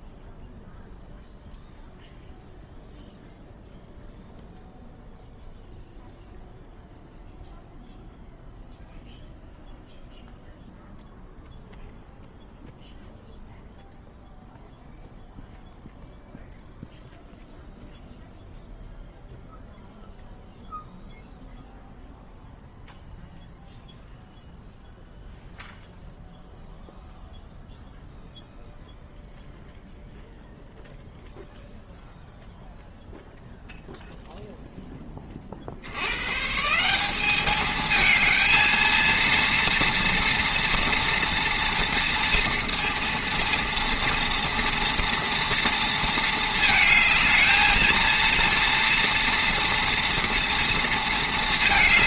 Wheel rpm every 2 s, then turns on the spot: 0, 0, 0, 0, 0, 0, 0, 0, 0, 0, 0, 0, 0, 0, 0, 0, 0, 10, 190, 230, 230, 230, 230, 220, 230, 230.
none